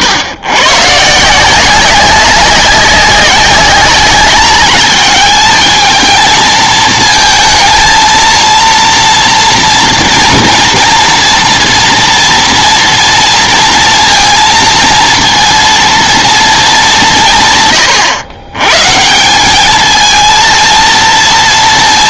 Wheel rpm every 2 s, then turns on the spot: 130, 190, 210, 220, 230, 230, 230, 230, 200, 140, 230.
none